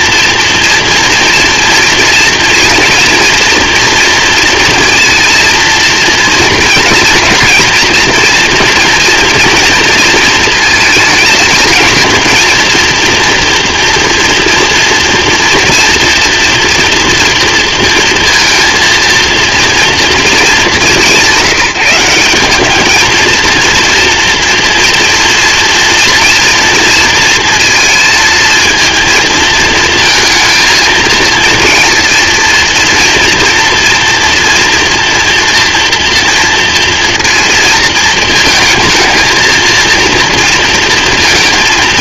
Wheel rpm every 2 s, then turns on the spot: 230, 240, 230, 230, 230, 230, 230, 240, 240, 230, 200, 200, 230, 230, 230, 230, 230, 240, 230, 220, 230.
none